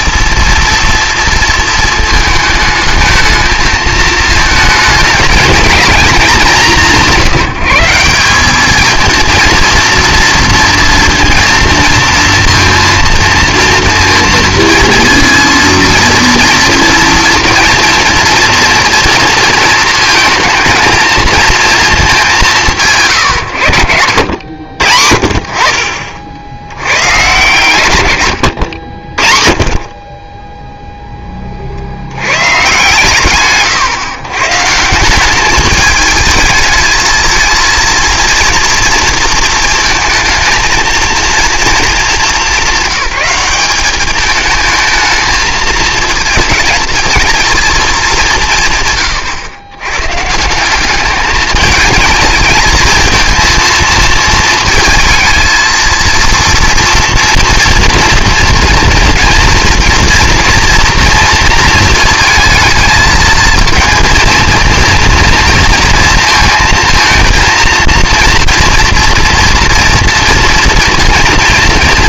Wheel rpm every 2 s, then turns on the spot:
230, 220, 220, 200, 210, 230, 220, 230, 240, 230, 220, 170, 60, 90, 70, 10, 130, 150, 220, 230, 230, 200, 210, 220, 150, 180, 220, 220, 230, 230, 230, 220, 230, 230, 230, 230.
none